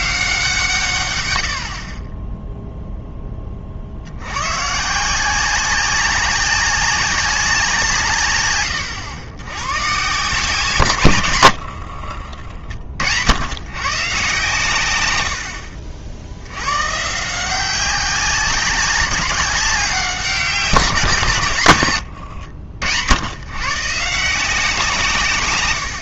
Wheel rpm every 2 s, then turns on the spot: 150, 0, 130, 190, 100, 150, 60, 120, 130, 190, 160, 90, 160.
none